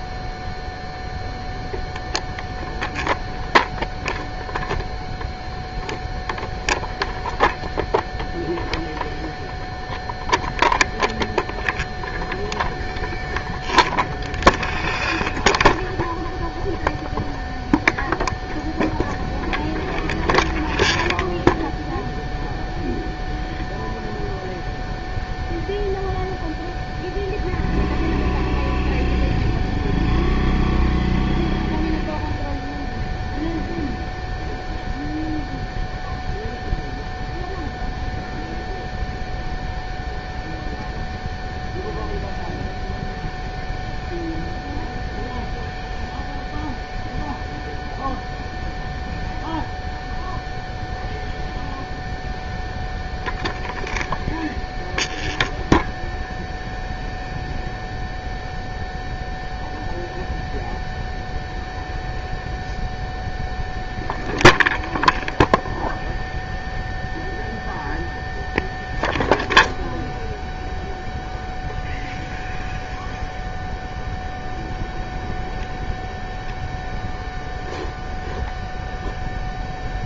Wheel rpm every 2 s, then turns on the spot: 0, 0, 0, 0, 0, 0, 0, 0, 0, 0, 0, 0, 0, 0, 0, 0, 0, 0, 0, 0, 0, 0, 0, 0, 0, 0, 0, 0, 0, 0, 0, 0, 0, 0, 0, 0, 0, 0, 0, 0.
none